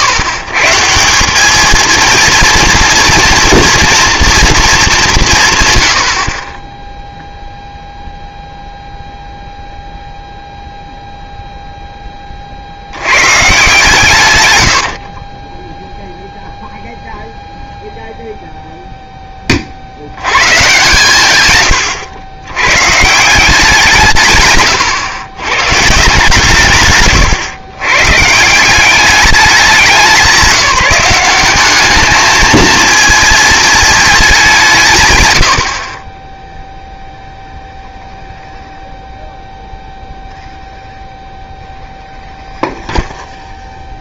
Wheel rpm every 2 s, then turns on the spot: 140, 230, 210, 0, 0, 0, 40, 100, 0, 0, 130, 120, 120, 140, 170, 190, 220, 180, 0, 0, 0, 0.
14-16 24-26